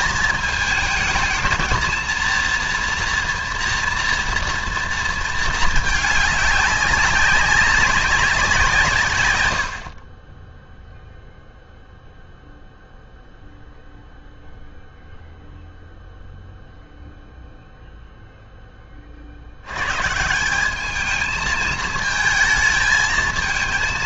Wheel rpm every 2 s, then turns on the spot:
220, 230, 230, 200, 150, 0, 0, 0, 0, 20, 200, 220.
none